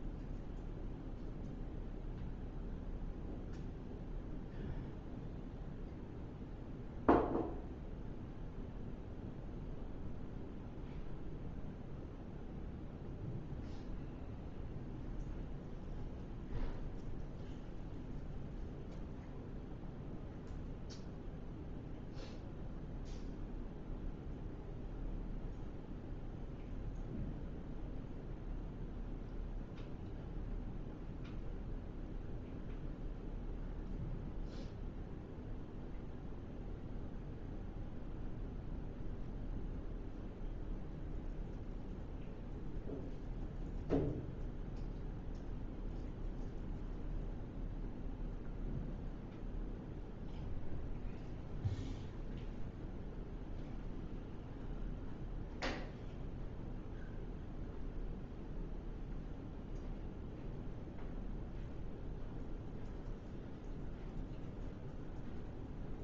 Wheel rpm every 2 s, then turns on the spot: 0, 0, 0, 0, 0, 0, 0, 0, 0, 0, 0, 0, 0, 0, 0, 0, 0, 0, 0, 0, 0, 0, 0, 0, 0, 0, 0, 0, 0, 0, 0, 0, 0.
none